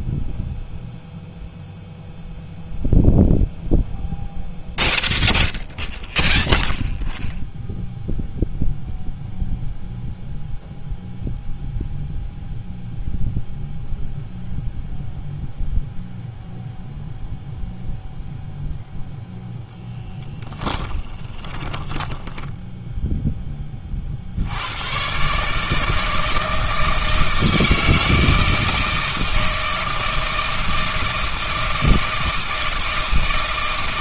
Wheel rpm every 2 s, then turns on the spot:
0, 0, 0, 0, 0, 0, 0, 0, 0, 0, 10, 10, 90, 160, 160, 160, 160.
20-22